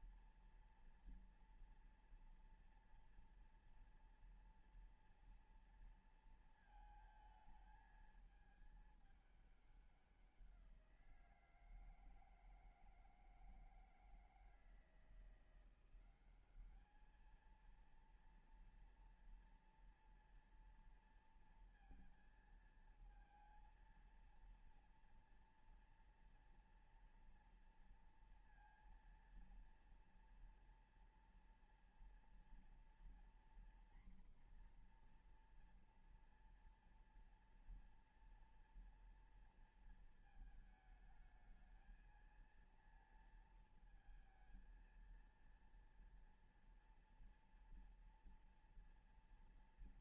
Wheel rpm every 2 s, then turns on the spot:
230, 230, 230, 230, 220, 190, 160, 160, 190, 230, 230, 220, 230, 230, 230, 230, 230, 240, 240, 230, 220, 220, 230, 230, 230.
none